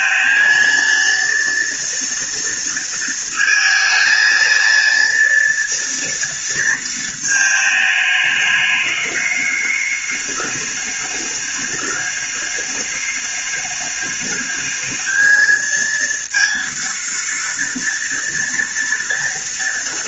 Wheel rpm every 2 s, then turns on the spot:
230, 230, 230, 230, 210, 210, 200, 210, 230, 230.
none